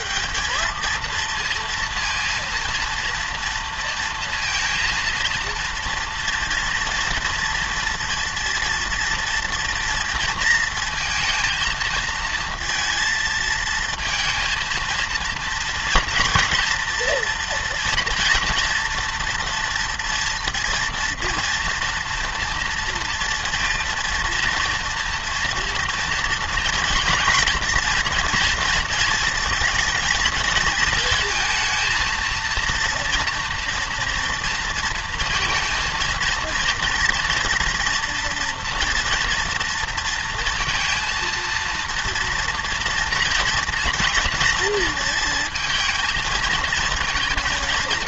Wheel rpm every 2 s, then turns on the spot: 210, 230, 230, 230, 230, 230, 230, 230, 230, 230, 240, 240, 230, 230, 230, 220, 230, 230, 230, 230, 230, 230, 230, 220.
none